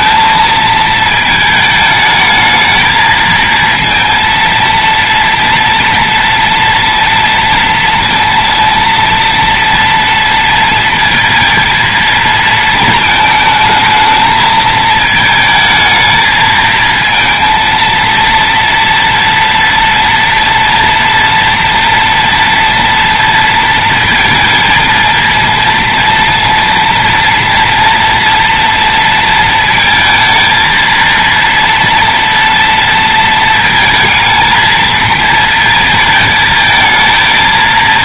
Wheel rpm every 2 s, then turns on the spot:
220, 220, 230, 230, 230, 230, 230, 220, 220, 230, 230, 240, 230, 240, 230, 230, 230, 230, 220.
none